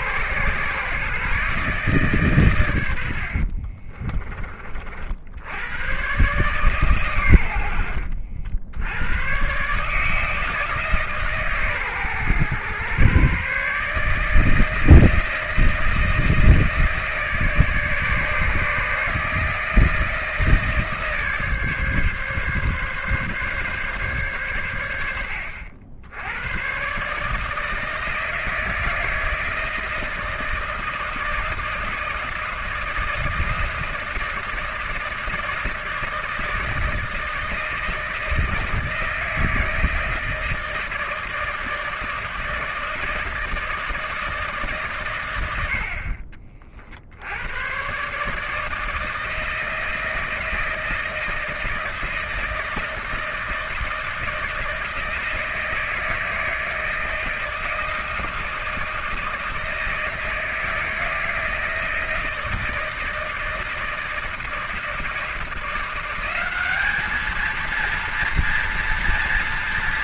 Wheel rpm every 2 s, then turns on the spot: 130, 120, 40, 130, 70, 150, 120, 160, 160, 150, 160, 140, 100, 110, 160, 160, 160, 160, 160, 160, 160, 160, 150, 50, 160, 160, 160, 170, 160, 160, 160, 160, 160, 200, 240.
none